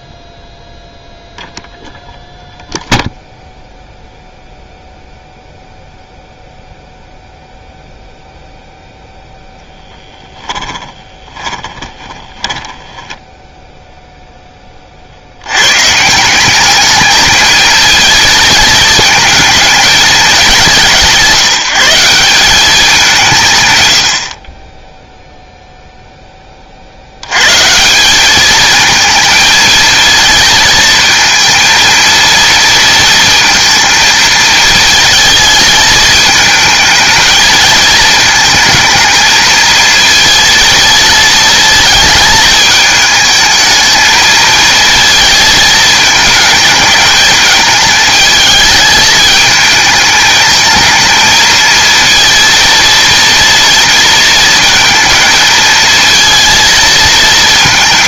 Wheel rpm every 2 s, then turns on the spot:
0, 0, 0, 0, 0, 10, 10, 20, 200, 220, 190, 190, 30, 30, 210, 220, 230, 220, 220, 220, 230, 220, 230, 220, 220, 220, 230, 230, 230.
10-14